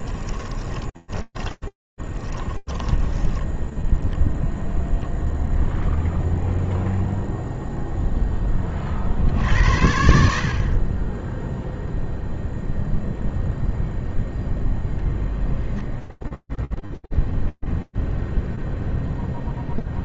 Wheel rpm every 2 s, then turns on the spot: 20, 10, 0, 0, 80, 0, 0, 10, 0, 0.
0-4